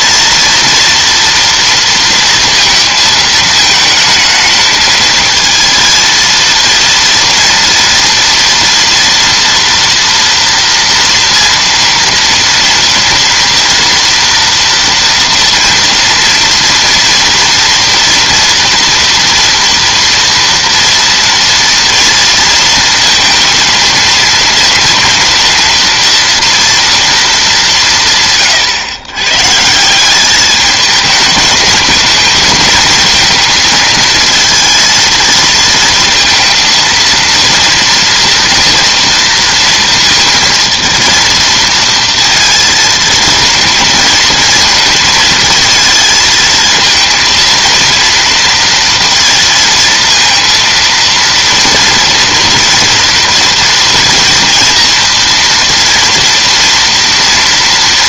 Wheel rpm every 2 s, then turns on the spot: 230, 220, 220, 230, 240, 230, 230, 230, 240, 230, 230, 230, 230, 230, 130, 220, 230, 220, 230, 230, 230, 230, 220, 230, 230, 230, 230, 230, 240.
none